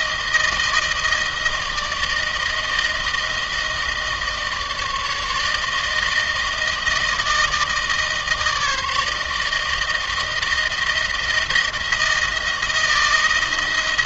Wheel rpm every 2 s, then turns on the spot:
160, 160, 160, 160, 150, 160, 160.
none